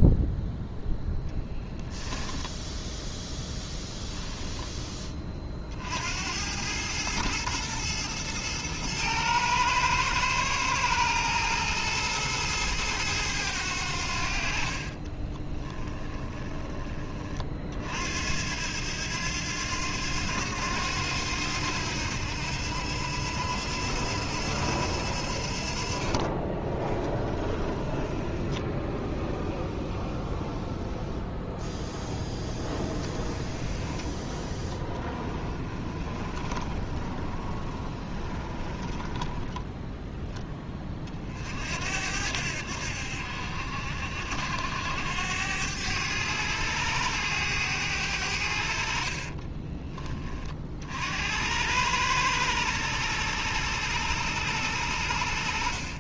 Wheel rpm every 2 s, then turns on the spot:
0, 0, 10, 100, 110, 110, 110, 50, 20, 80, 90, 80, 80, 30, 10, 0, 10, 10, 20, 20, 30, 80, 80, 100, 60, 50, 100, 90.
14-16 26-30 34-40